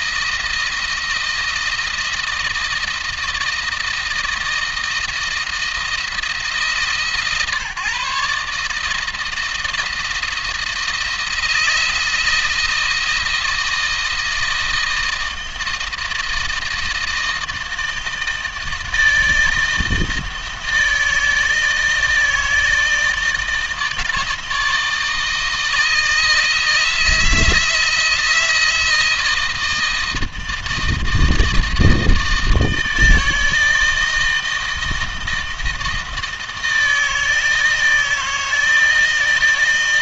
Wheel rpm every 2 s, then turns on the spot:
160, 160, 160, 160, 160, 170, 170, 160, 160, 160, 160, 160, 160, 160, 160, 160, 160, 160, 160, 160.
none